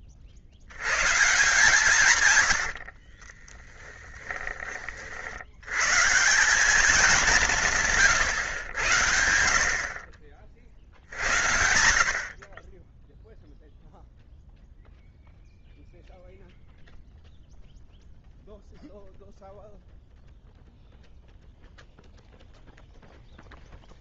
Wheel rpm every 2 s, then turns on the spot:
80, 100, 20, 190, 110, 60, 40, 0, 0, 0, 0, 0.
2-4